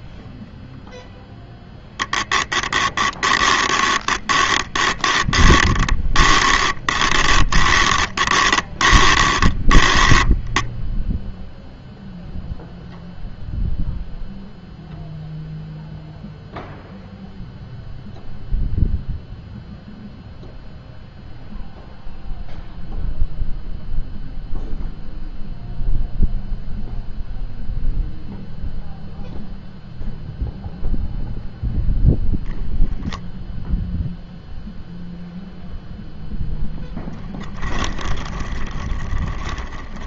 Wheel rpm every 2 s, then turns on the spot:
0, 10, 20, 30, 20, 0, 0, 0, 0, 0, 0, 0, 0, 0, 0, 0, 0, 0, 0, 20.
2-10 38-40